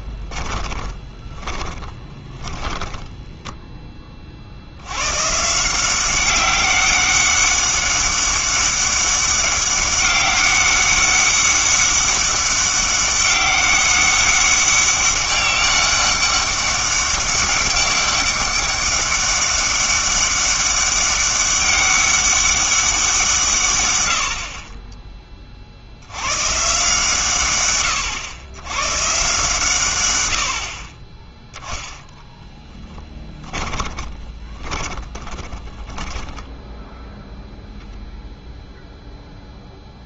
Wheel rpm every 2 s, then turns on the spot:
20, 10, 70, 200, 200, 200, 200, 200, 200, 200, 200, 190, 20, 140, 130, 50, 10, 20, 10, 0.
0-4 32-36